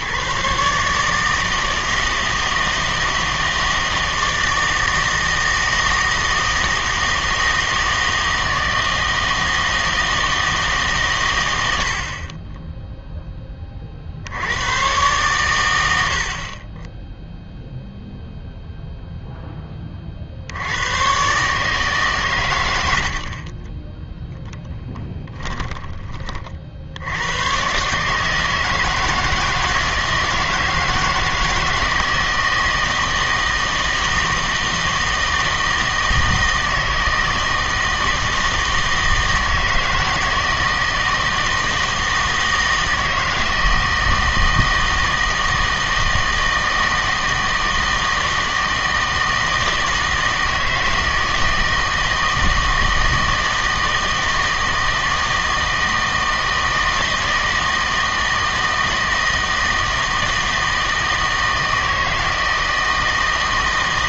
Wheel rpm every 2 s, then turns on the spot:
150, 160, 160, 160, 160, 160, 10, 100, 30, 0, 80, 120, 10, 50, 160, 160, 160, 160, 160, 160, 160, 160, 160, 160, 160, 160, 160, 160, 160, 160, 160, 160.
24-26